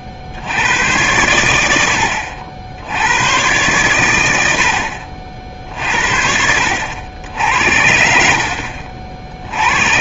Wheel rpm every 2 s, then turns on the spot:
70, 80, 90, 70, 70.
none